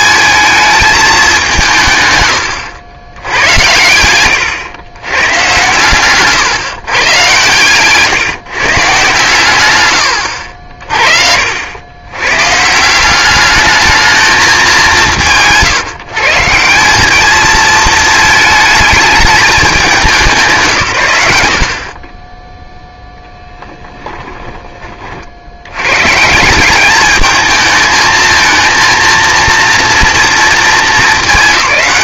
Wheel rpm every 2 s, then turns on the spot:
220, 100, 110, 130, 150, 60, 150, 200, 160, 220, 150, 0, 20, 180, 230, 230.
none